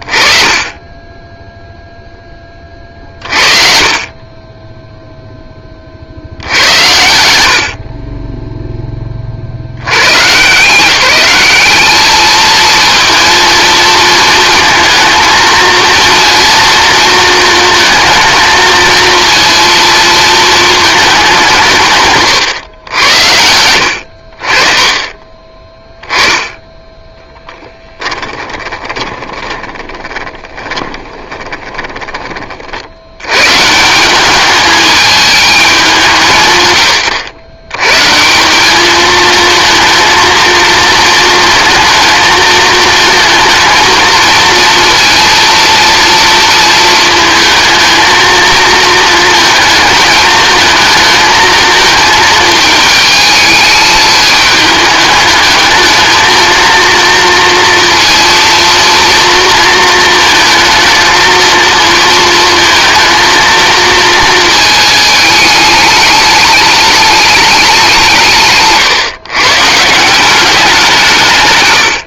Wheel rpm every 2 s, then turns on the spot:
20, 20, 20, 90, 10, 170, 230, 230, 230, 230, 220, 100, 30, 10, 20, 20, 80, 210, 100, 220, 230, 220, 230, 220, 220, 220, 220, 210, 230, 230, 230, 230, 220, 210, 140, 170.
6-8 28-32